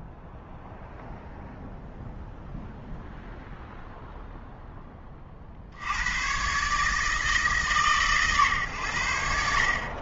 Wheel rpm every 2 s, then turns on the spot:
0, 0, 10, 140, 110.
none